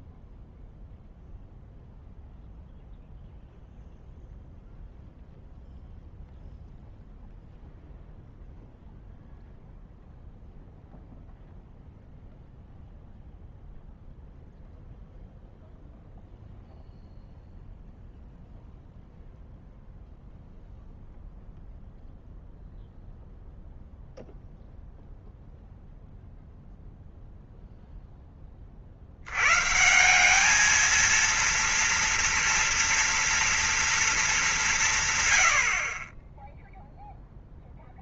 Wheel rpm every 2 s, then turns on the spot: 0, 0, 0, 0, 0, 0, 0, 0, 0, 0, 0, 0, 0, 0, 60, 220, 240, 170, 10.
none